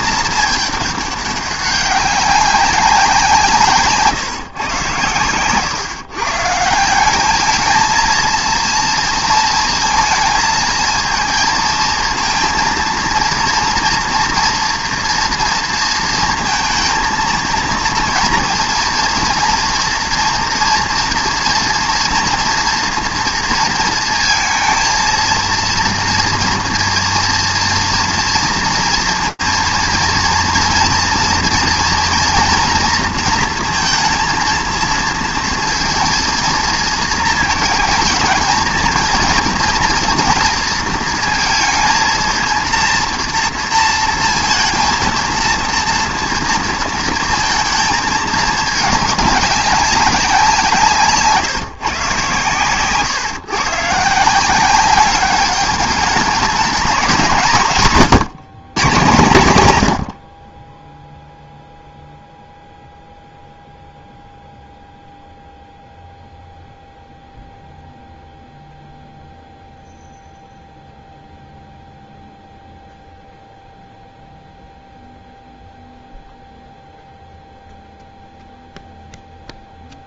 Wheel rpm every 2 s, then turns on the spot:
210, 190, 130, 160, 230, 220, 230, 230, 220, 230, 230, 230, 230, 230, 230, 230, 240, 230, 230, 220, 230, 230, 230, 230, 210, 180, 130, 180, 210, 170, 30, 0, 0, 0, 0, 0, 0, 0, 0, 0.
none